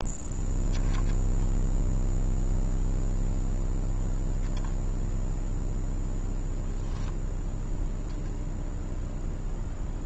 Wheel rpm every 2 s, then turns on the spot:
0, 0, 0, 0, 0.
none